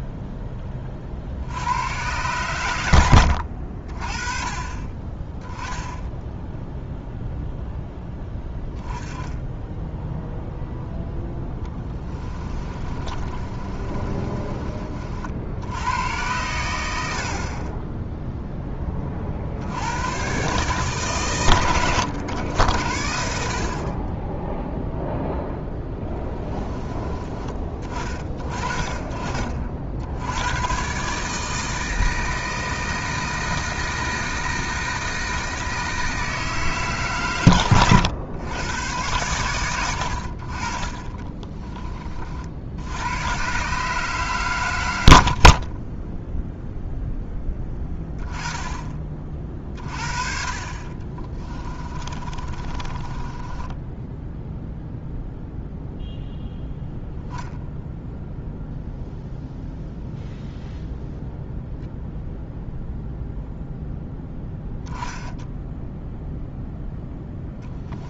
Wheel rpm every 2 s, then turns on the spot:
40, 90, 20, 0, 10, 0, 30, 40, 90, 20, 140, 80, 0, 20, 30, 130, 160, 160, 140, 110, 30, 80, 90, 0, 30, 30, 20, 0, 0, 0, 0, 0, 0, 0.
12-14 40-42 50-54